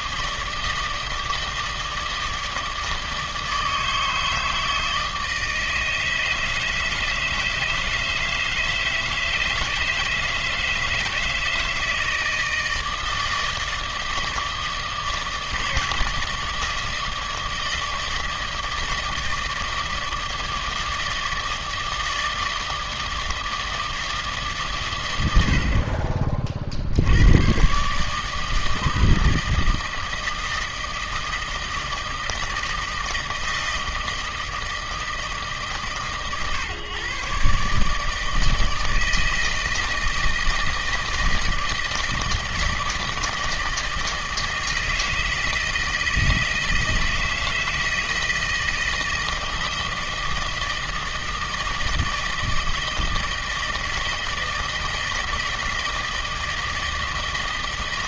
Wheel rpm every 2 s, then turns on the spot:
160, 160, 160, 160, 160, 160, 160, 160, 160, 160, 160, 160, 130, 60, 160, 160, 160, 160, 140, 160, 160, 160, 160, 160, 160, 160, 160, 160, 160.
none